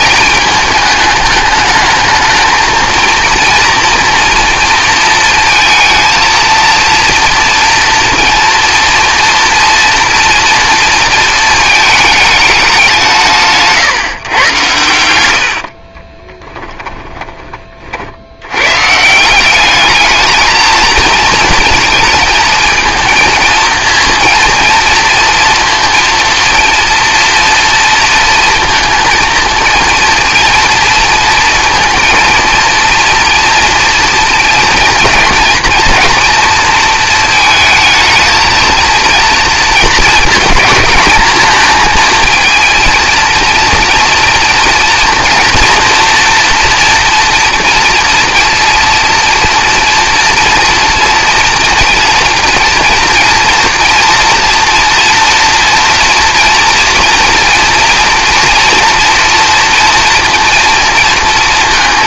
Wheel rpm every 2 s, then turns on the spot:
210, 220, 230, 230, 230, 230, 200, 110, 20, 110, 220, 230, 230, 230, 230, 230, 230, 230, 230, 220, 220, 230, 230, 230, 230, 230, 230, 230, 230, 230, 230.
16-18